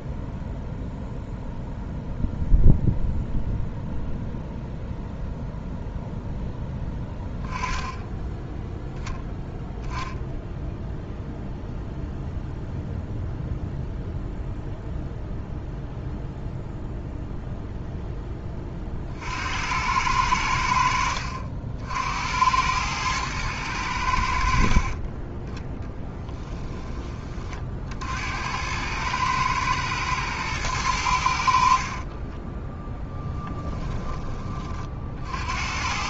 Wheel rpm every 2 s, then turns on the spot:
0, 0, 0, 10, 0, 0, 0, 0, 0, 30, 80, 100, 50, 20, 100, 100, 10, 40.
32-34